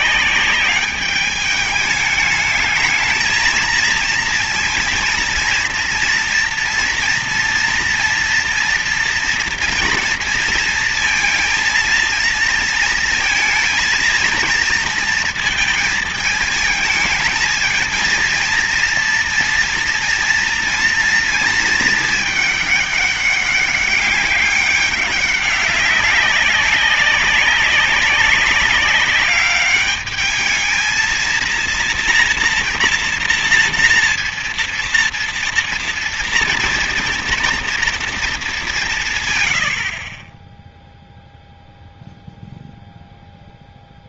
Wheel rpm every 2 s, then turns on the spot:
200, 220, 230, 230, 230, 230, 230, 230, 220, 230, 230, 210, 200, 200, 200, 220, 230, 230, 230, 180, 10, 0.
none